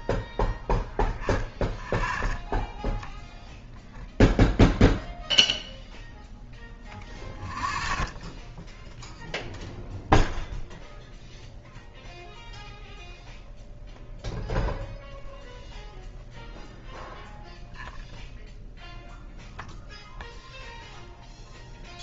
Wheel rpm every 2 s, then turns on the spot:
0, 0, 0, 0, 0, 0, 0, 0, 0, 0, 0.
none